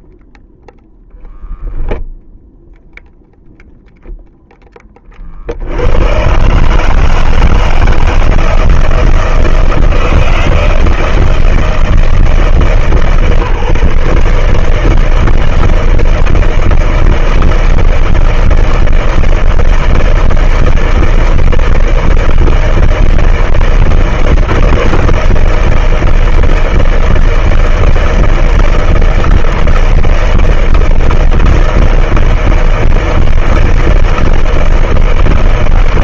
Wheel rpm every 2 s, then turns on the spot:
0, 0, 30, 160, 160, 160, 150, 160, 160, 160, 160, 160, 170, 160, 160, 160, 160, 160.
none